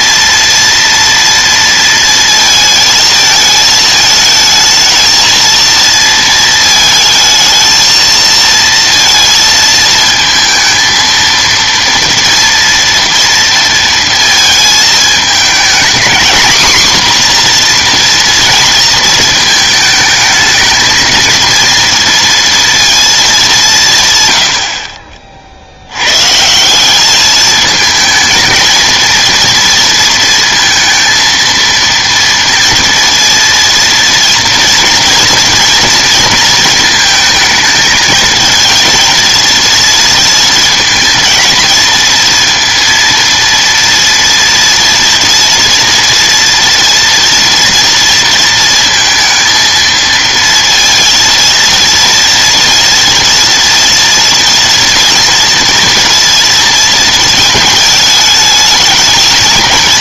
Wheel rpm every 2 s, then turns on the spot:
230, 220, 220, 220, 230, 220, 230, 220, 250, 230, 220, 230, 80, 160, 230, 230, 230, 230, 230, 220, 230, 230, 230, 230, 230, 230, 230, 230, 230, 210.
none